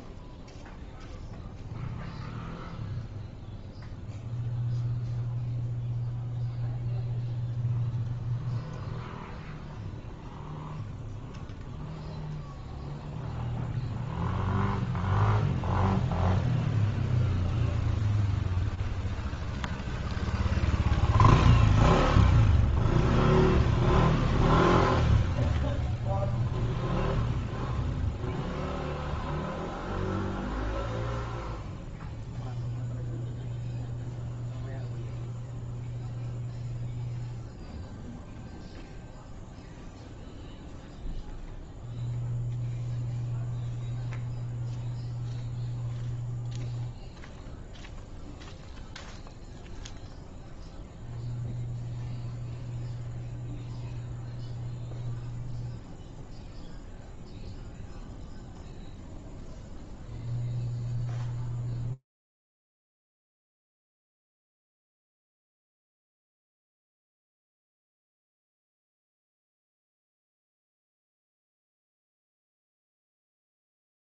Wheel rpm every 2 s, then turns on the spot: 0, 0, 0, 0, 0, 0, 0, 0, 0, 0, 0, 0, 0, 0, 0, 0, 0, 0, 0, 0, 0, 0, 0, 0, 0, 0, 0, 0, 0, 0, 0, 0, 0, 0, 0, 0, 0.
none